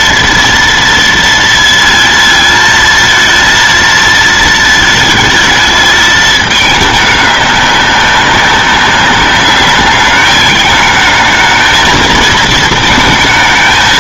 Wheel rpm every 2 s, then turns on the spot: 230, 230, 220, 210, 200, 220, 220.
none